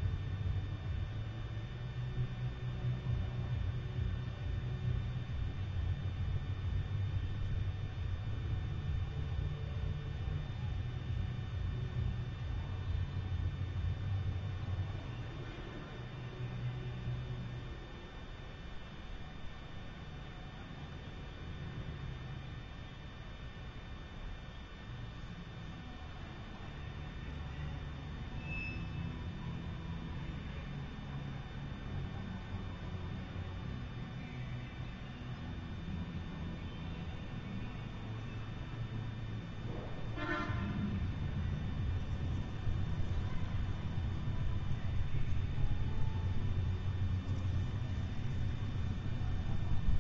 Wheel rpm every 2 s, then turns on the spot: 0, 0, 0, 0, 0, 0, 0, 0, 0, 0, 0, 0, 0, 0, 0, 0, 0, 0, 0, 0, 0, 0, 0, 0, 0.
none